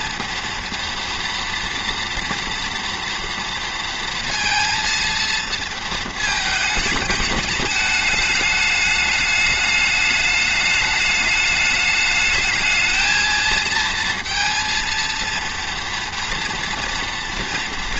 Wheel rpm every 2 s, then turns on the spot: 230, 230, 230, 210, 210, 210, 220, 230, 230.
none